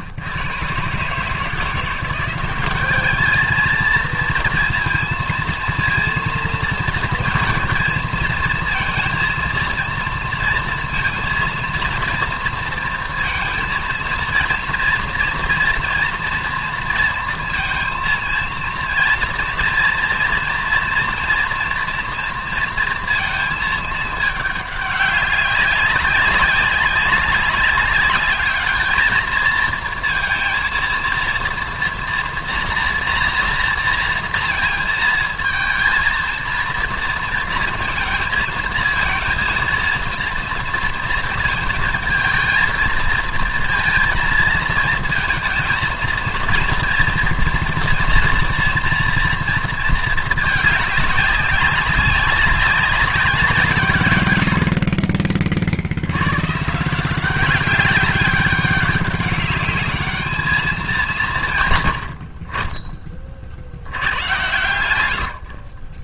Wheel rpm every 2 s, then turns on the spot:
140, 210, 230, 230, 230, 230, 230, 230, 230, 230, 230, 230, 200, 200, 210, 230, 230, 220, 230, 230, 230, 230, 230, 230, 240, 200, 190, 40, 170, 200, 190, 30, 70.
64-66